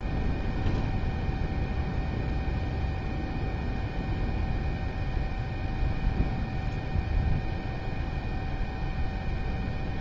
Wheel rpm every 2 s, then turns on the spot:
0, 0, 0, 0, 0.
none